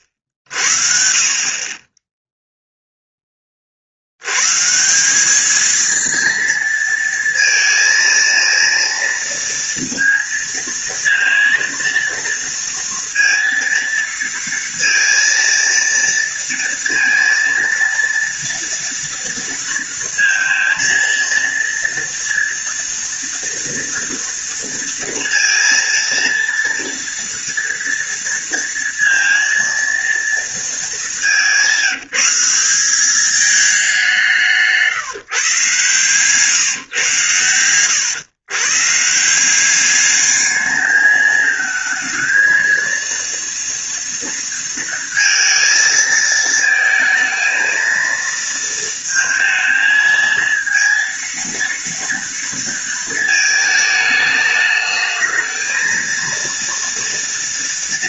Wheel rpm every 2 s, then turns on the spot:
60, 0, 130, 230, 230, 230, 230, 230, 230, 230, 230, 230, 230, 230, 230, 220, 190, 160, 130, 130, 210, 230, 230, 230, 230, 230, 230, 210, 230.
none